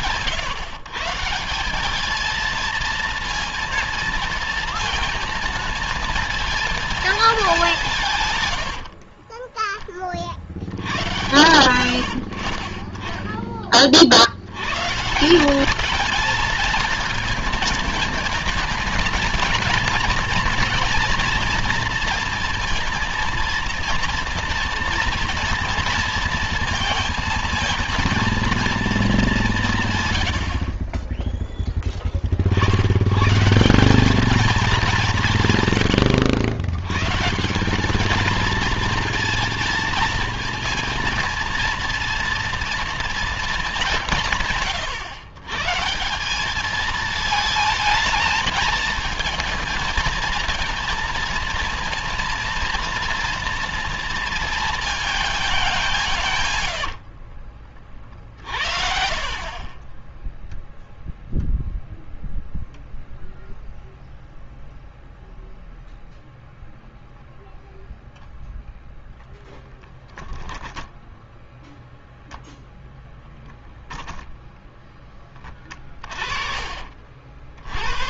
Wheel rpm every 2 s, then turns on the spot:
150, 230, 230, 220, 60, 100, 40, 120, 220, 220, 240, 230, 230, 230, 230, 50, 70, 210, 110, 230, 230, 240, 150, 210, 220, 230, 230, 230, 100, 50, 0, 0, 0, 0, 0, 10, 0, 0, 50.
70-72